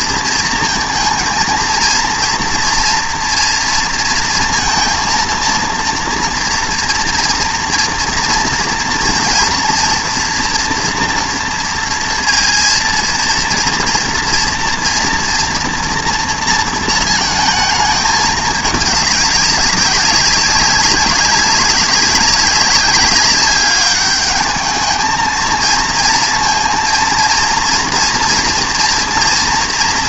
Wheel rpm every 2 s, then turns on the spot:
230, 240, 230, 230, 230, 240, 230, 230, 230, 210, 200, 200, 210, 230, 230.
none